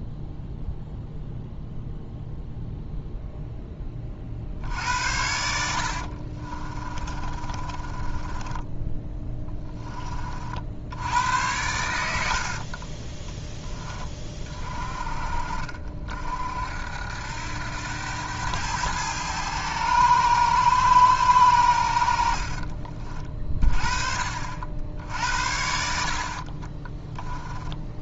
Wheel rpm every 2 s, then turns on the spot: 0, 0, 60, 30, 10, 70, 40, 30, 70, 100, 110, 40, 60, 20.
6-10 12-14 26-28